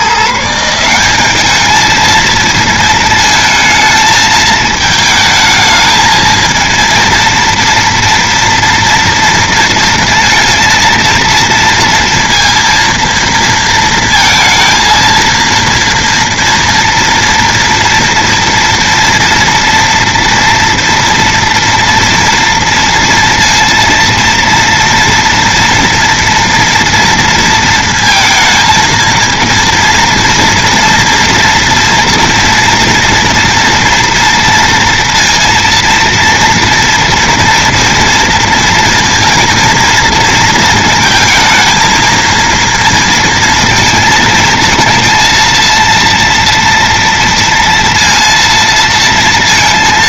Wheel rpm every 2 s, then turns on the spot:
170, 220, 220, 230, 230, 230, 230, 230, 230, 230, 230, 230, 240, 230, 230, 230, 230, 230, 230, 240, 230, 230, 220, 240, 230.
none